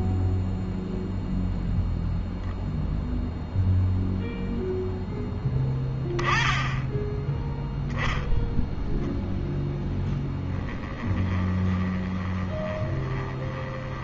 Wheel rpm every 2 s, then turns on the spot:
0, 0, 0, 10, 0, 10, 20.
10-14